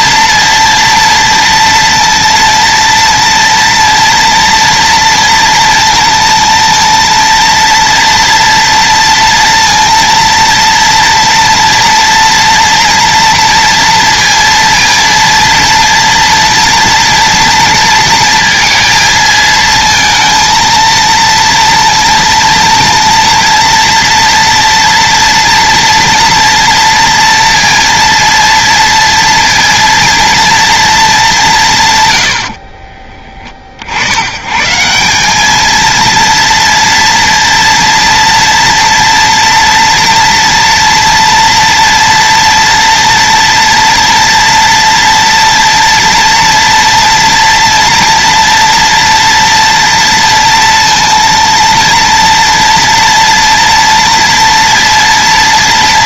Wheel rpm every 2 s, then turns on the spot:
230, 230, 230, 230, 230, 230, 230, 230, 230, 220, 230, 230, 230, 230, 230, 210, 30, 180, 230, 230, 240, 240, 240, 230, 230, 230, 240, 230.
none